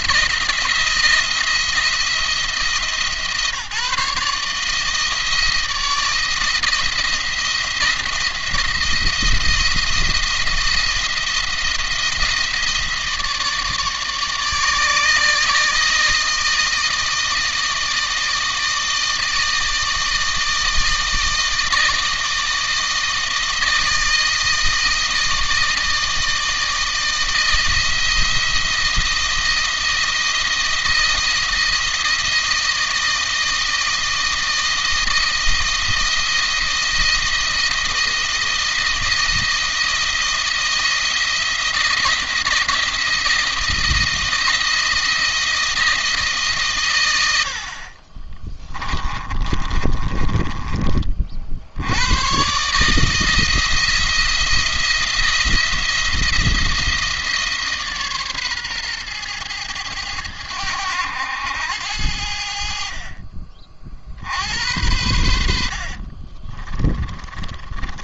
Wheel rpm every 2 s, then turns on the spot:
170, 160, 160, 170, 170, 170, 160, 150, 160, 160, 160, 160, 160, 160, 170, 170, 160, 160, 160, 170, 160, 160, 160, 130, 20, 30, 140, 170, 170, 130, 100, 60, 90, 40.
48-50 66-68